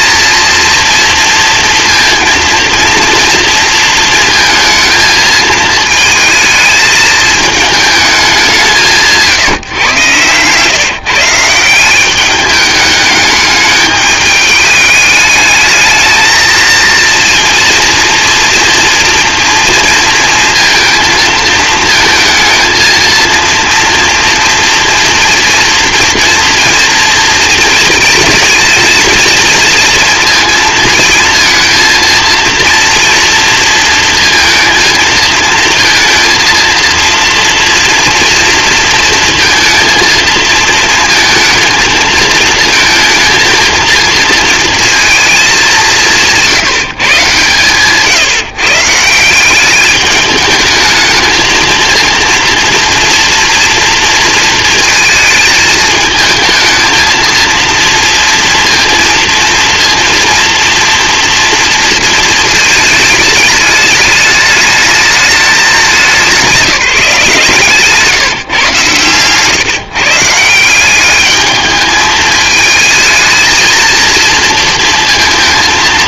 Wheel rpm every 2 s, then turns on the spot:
230, 230, 220, 220, 180, 140, 210, 210, 230, 230, 230, 220, 230, 230, 230, 230, 230, 230, 230, 230, 230, 220, 230, 170, 150, 220, 230, 230, 220, 230, 230, 220, 210, 180, 140, 170, 220, 230.
none